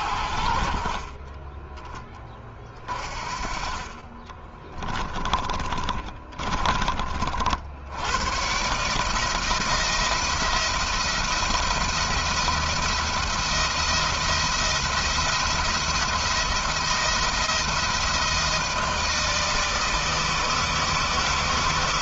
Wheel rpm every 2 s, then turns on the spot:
40, 40, 20, 40, 140, 170, 170, 170, 170, 160, 160.
0-2 4-6